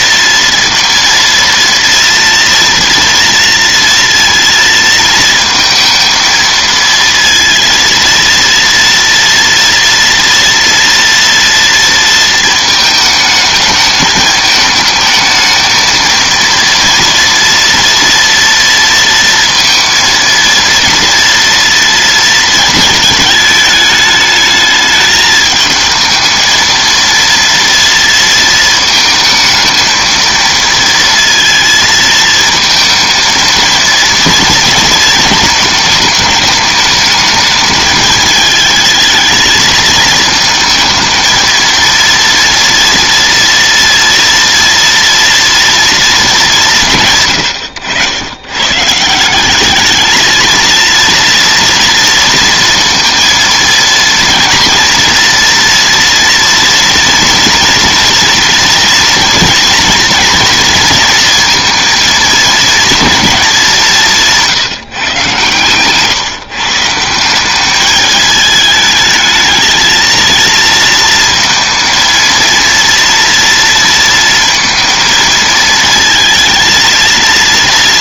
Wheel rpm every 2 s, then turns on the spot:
230, 230, 220, 230, 240, 230, 220, 220, 230, 230, 230, 220, 220, 230, 220, 230, 220, 220, 210, 220, 220, 240, 230, 120, 170, 230, 230, 230, 230, 230, 230, 220, 130, 180, 220, 230, 230, 230, 230.
none